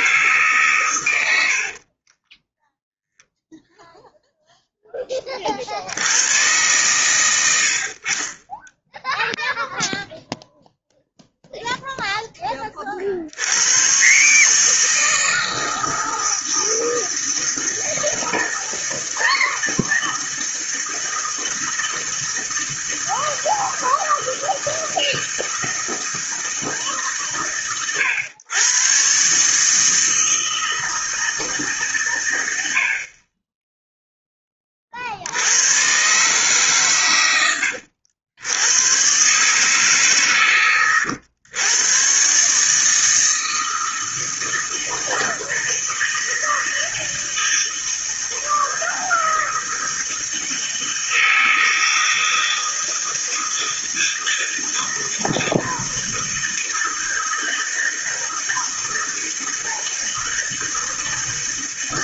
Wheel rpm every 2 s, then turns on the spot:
120, 0, 10, 110, 10, 0, 30, 160, 160, 160, 160, 160, 160, 150, 120, 160, 70, 30, 130, 110, 120, 150, 160, 160, 160, 160, 160, 160, 160, 160, 160.
none